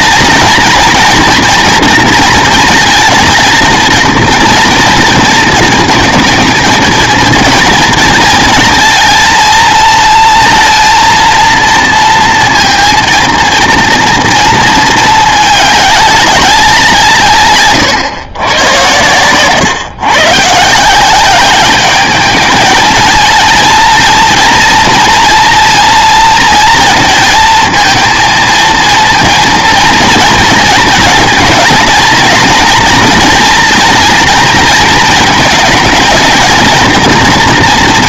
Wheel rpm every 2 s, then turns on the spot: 240, 220, 230, 230, 230, 230, 230, 220, 190, 110, 160, 220, 230, 230, 230, 220, 230, 230, 220.
none